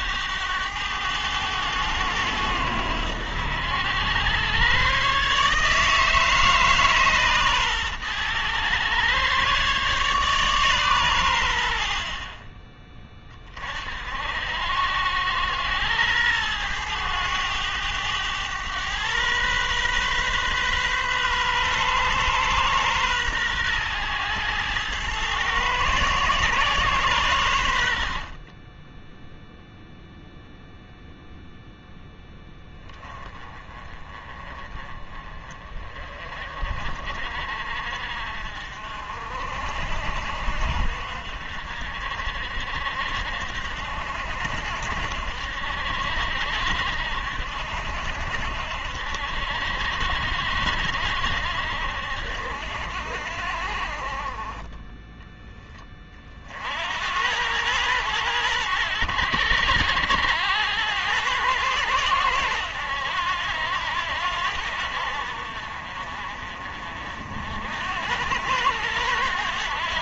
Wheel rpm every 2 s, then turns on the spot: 100, 90, 130, 140, 120, 120, 30, 80, 110, 110, 130, 120, 110, 120, 10, 0, 20, 30, 40, 50, 60, 60, 70, 70, 70, 70, 60, 10, 80, 100, 100, 90, 70, 50, 90.
none